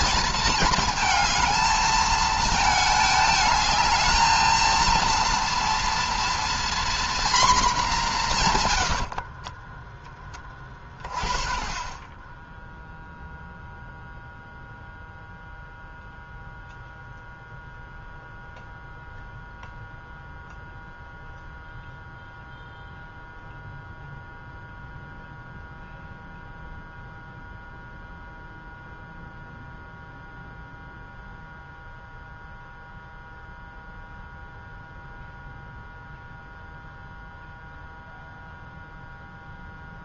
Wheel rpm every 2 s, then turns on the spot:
220, 220, 230, 240, 100, 30, 0, 0, 0, 0, 0, 0, 0, 0, 0, 0, 0, 0, 0, 0.
8-10